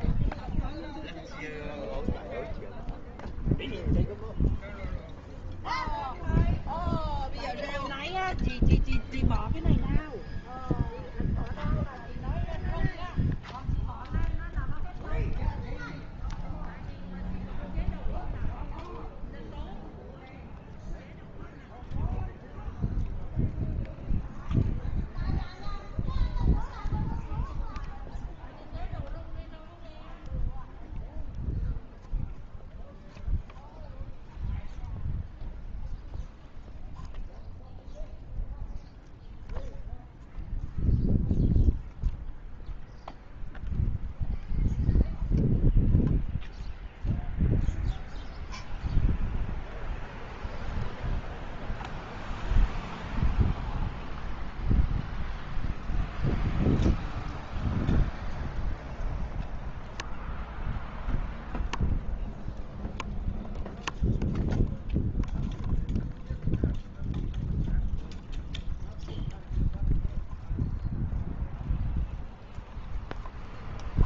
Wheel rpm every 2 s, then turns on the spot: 0, 0, 0, 0, 0, 0, 0, 0, 0, 0, 0, 0, 0, 0, 0, 0, 0, 0, 0, 0, 0, 0, 0, 0, 0, 0, 0, 0, 0, 0, 0, 0, 0, 0, 0, 0, 0.
none